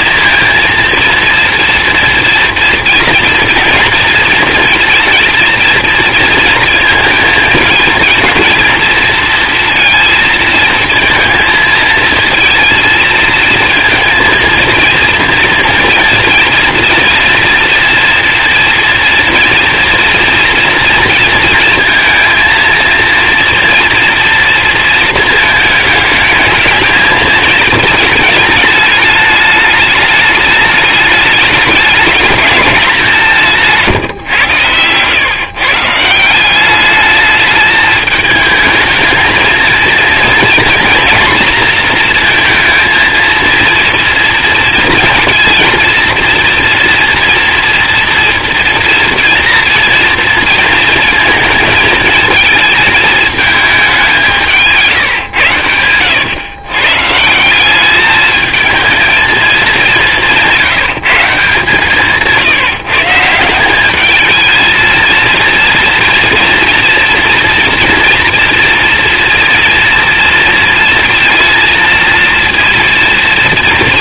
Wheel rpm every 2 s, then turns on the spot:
230, 230, 230, 220, 230, 230, 230, 230, 240, 230, 230, 230, 220, 210, 210, 220, 170, 140, 220, 230, 230, 230, 230, 230, 230, 220, 210, 110, 180, 210, 150, 180, 230, 240, 230, 230, 230.
none